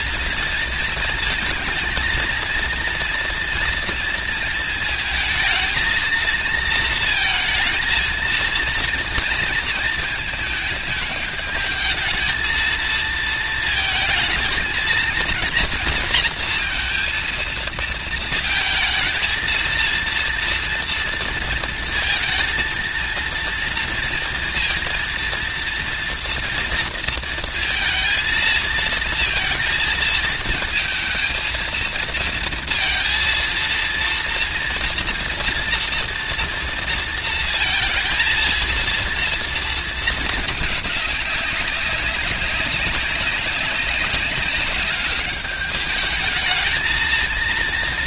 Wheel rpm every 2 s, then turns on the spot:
230, 230, 220, 230, 220, 220, 220, 230, 230, 230, 230, 230, 230, 230, 230, 220, 230, 240, 230, 230, 210, 200, 200, 220.
none